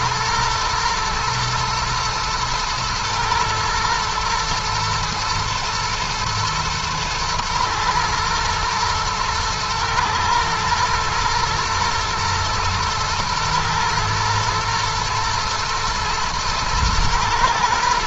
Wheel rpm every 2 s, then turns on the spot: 120, 110, 110, 110, 110, 110, 120, 110, 110.
none